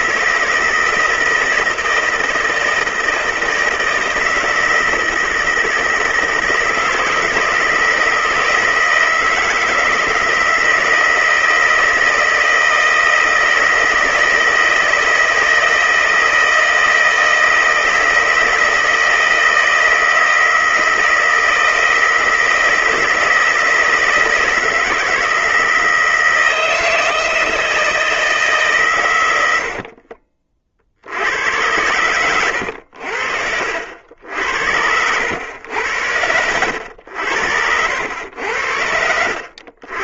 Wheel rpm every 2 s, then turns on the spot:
160, 160, 160, 160, 160, 160, 160, 160, 160, 160, 160, 160, 160, 160, 110, 60, 80, 90, 80, 70.
none